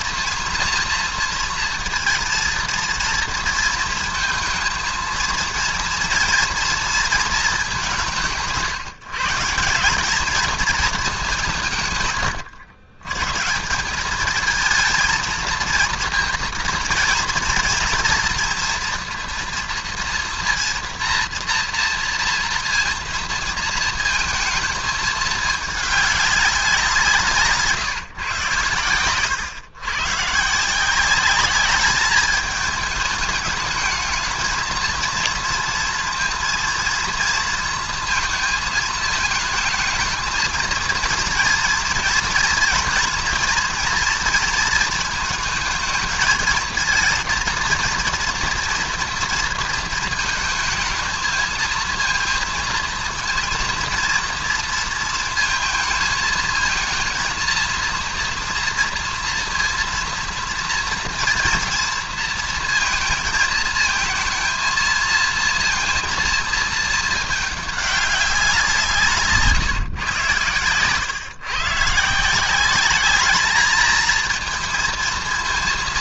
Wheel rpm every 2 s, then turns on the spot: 230, 230, 220, 230, 180, 210, 110, 200, 230, 240, 230, 240, 230, 200, 130, 130, 210, 220, 230, 230, 220, 230, 230, 220, 240, 230, 230, 230, 220, 230, 230, 230, 220, 230, 200, 130, 150, 220.
none